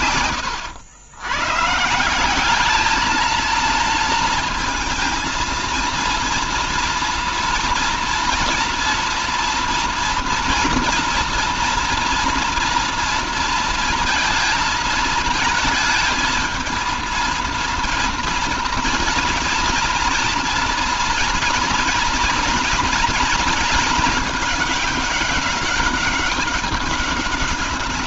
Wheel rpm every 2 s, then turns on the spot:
120, 220, 230, 230, 230, 230, 230, 220, 230, 230, 230, 230, 210, 200.
0-2